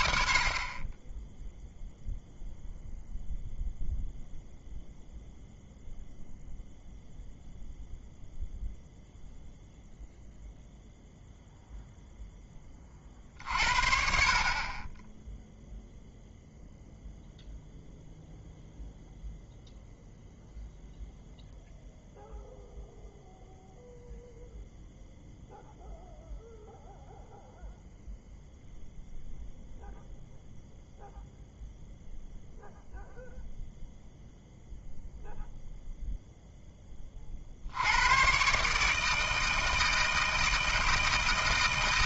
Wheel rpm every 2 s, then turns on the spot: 40, 0, 0, 0, 0, 0, 20, 30, 0, 0, 0, 0, 0, 0, 0, 0, 0, 0, 10, 140, 160.
none